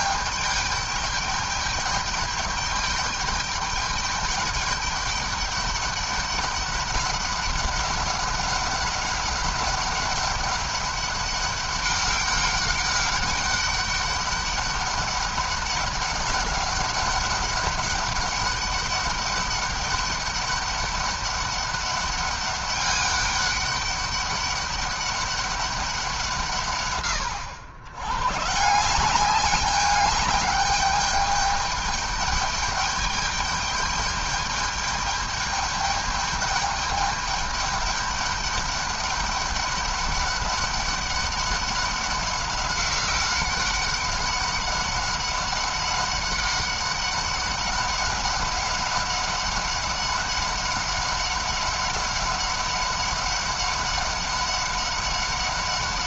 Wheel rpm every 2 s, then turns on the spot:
210, 210, 210, 200, 200, 200, 200, 200, 200, 200, 200, 200, 200, 160, 140, 210, 200, 210, 210, 200, 200, 190, 200, 190, 200, 190, 190, 200.
none